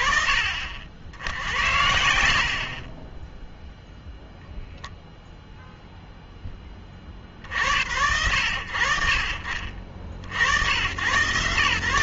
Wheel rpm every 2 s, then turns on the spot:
40, 0, 0, 20, 40, 110.
none